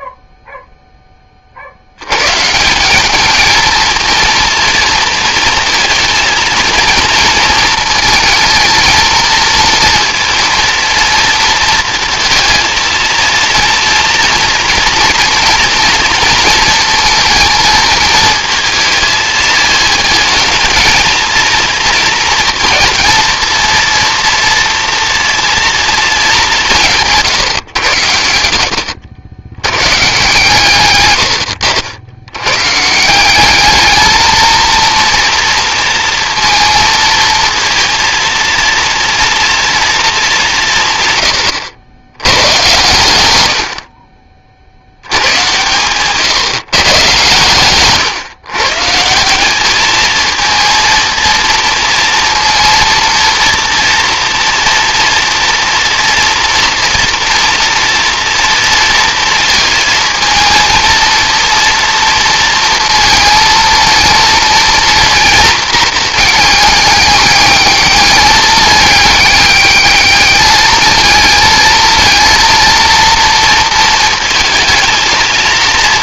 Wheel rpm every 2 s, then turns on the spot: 0, 150, 230, 230, 220, 230, 230, 230, 230, 220, 220, 230, 230, 200, 70, 140, 120, 220, 230, 230, 180, 100, 40, 140, 130, 230, 230, 230, 240, 230, 220, 230, 230, 220, 210, 220, 230, 230.
none